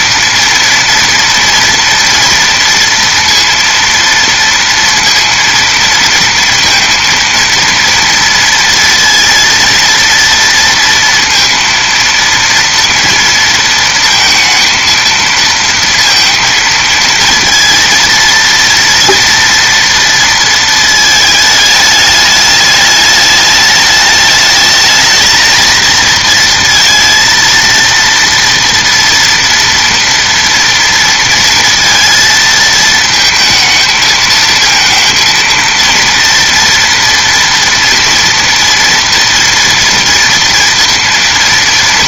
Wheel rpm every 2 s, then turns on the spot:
230, 230, 230, 230, 230, 230, 230, 230, 230, 230, 230, 210, 220, 230, 230, 230, 220, 230, 230, 230, 230.
none